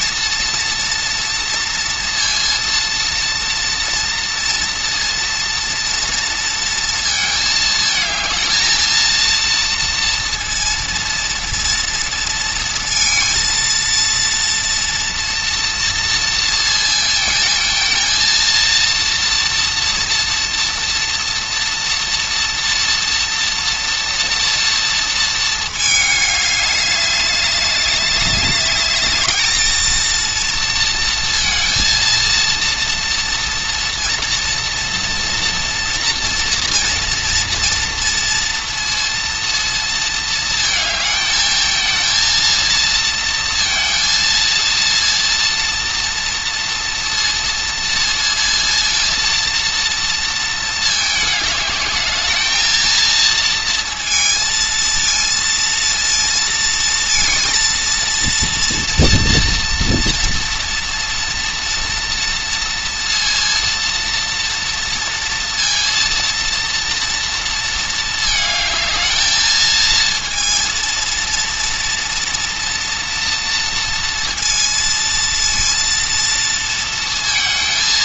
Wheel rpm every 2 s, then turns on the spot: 230, 230, 230, 230, 230, 230, 230, 230, 230, 230, 230, 230, 230, 200, 210, 230, 230, 230, 230, 230, 220, 230, 230, 230, 230, 220, 220, 220, 230, 230, 240, 230, 230, 230, 220, 230, 230, 230, 230.
none